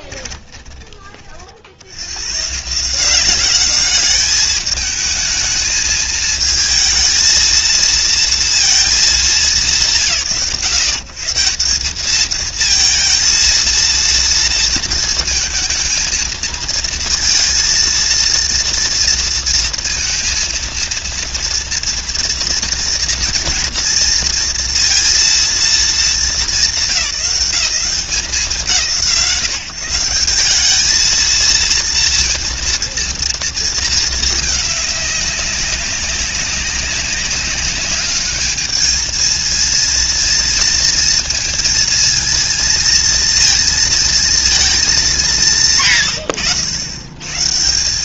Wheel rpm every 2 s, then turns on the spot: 20, 140, 210, 220, 230, 120, 220, 230, 220, 230, 230, 230, 230, 190, 140, 190, 230, 210, 200, 210, 230, 230, 220, 70.
0-2